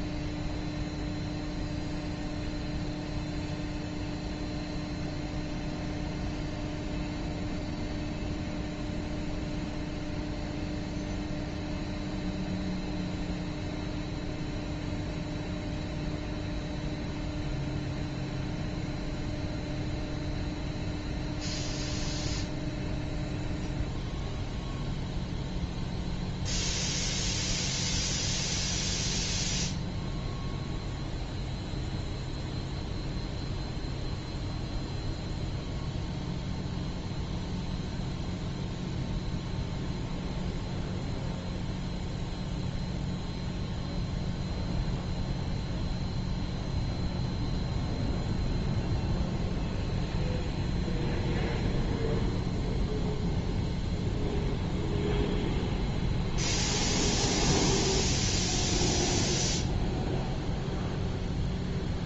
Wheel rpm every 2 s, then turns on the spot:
0, 0, 0, 0, 0, 0, 0, 0, 0, 0, 0, 0, 0, 0, 0, 0, 0, 0, 0, 0, 0, 0, 0, 0, 0, 0, 0, 0, 0, 0, 0.
none